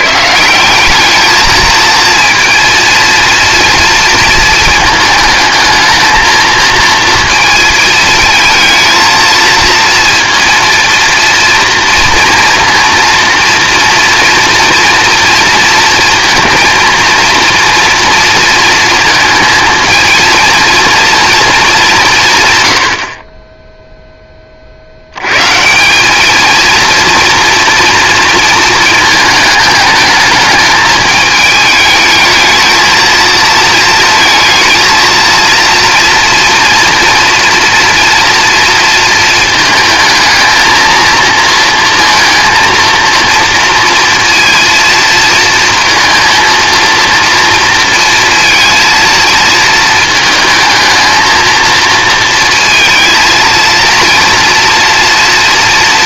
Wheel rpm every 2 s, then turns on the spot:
190, 230, 220, 230, 220, 230, 230, 230, 230, 230, 230, 110, 40, 220, 230, 220, 220, 230, 230, 230, 220, 230, 230, 230, 230, 220, 230, 240.
none